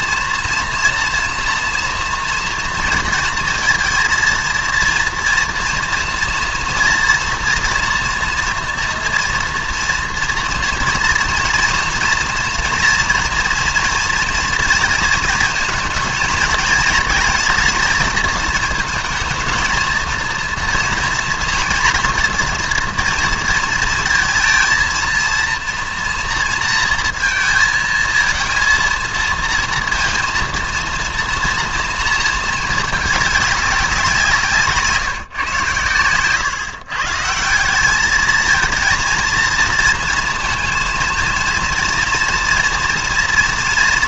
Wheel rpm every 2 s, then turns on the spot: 230, 230, 230, 230, 240, 230, 230, 230, 220, 230, 240, 230, 230, 230, 230, 230, 220, 160, 140, 220, 230, 230.
none